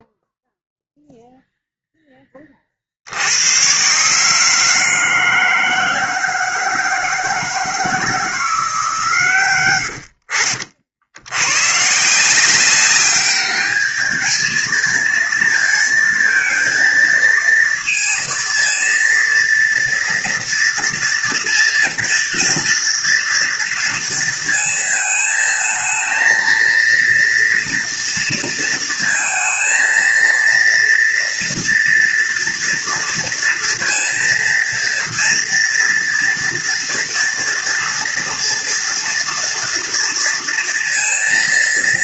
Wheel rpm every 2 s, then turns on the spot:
0, 30, 160, 160, 160, 70, 190, 220, 230, 230, 230, 230, 230, 230, 230, 230, 230, 230, 230, 230, 230.
none